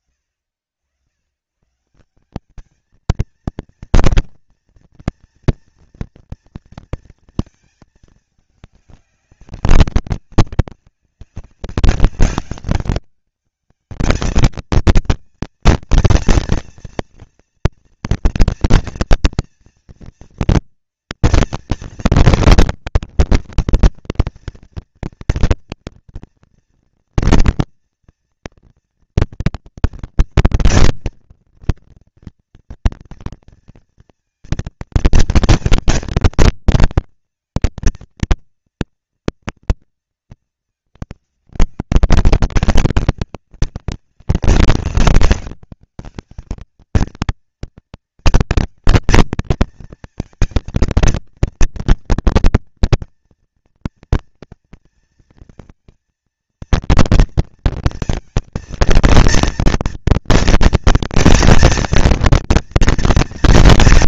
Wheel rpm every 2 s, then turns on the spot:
90, 220, 240, 230, 200, 200, 200, 220, 230, 230, 230, 240, 230, 230, 230, 240, 240, 230, 230, 230, 210, 190, 200, 220, 220, 230, 230, 230, 230, 230, 230, 230.
none